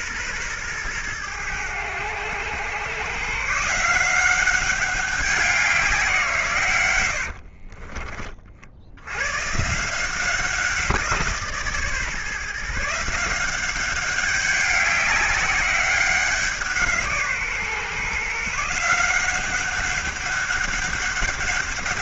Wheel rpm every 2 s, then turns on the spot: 120, 110, 190, 140, 70, 180, 150, 200, 180, 160, 200.
none